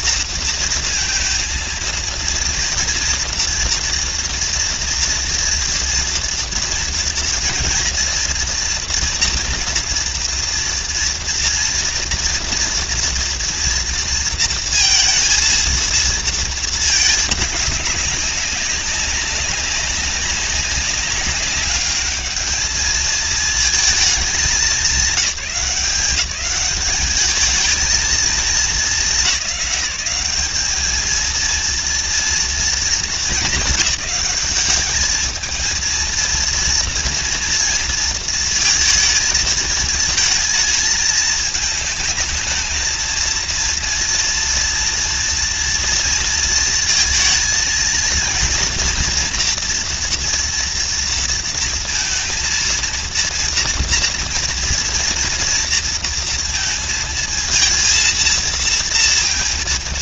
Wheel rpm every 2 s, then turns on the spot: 230, 230, 230, 230, 230, 240, 230, 230, 220, 190, 200, 220, 220, 200, 210, 220, 210, 200, 230, 230, 220, 220, 230, 230, 240, 230, 230, 230, 230, 230.
none